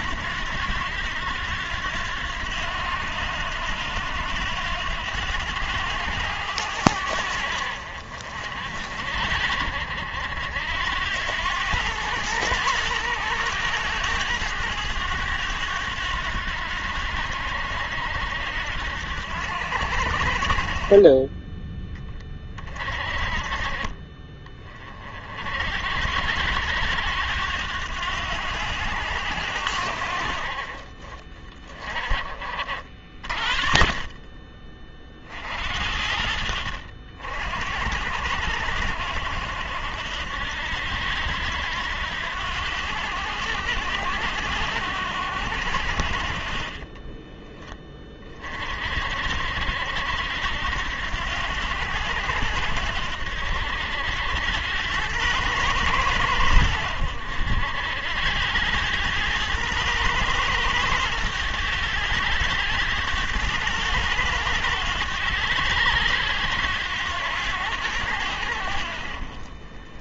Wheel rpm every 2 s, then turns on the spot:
90, 90, 90, 80, 50, 80, 100, 100, 80, 80, 40, 30, 30, 80, 90, 40, 50, 40, 70, 80, 80, 90, 90, 40, 40, 80, 80, 90, 90, 90, 110, 100, 100, 90, 80.
none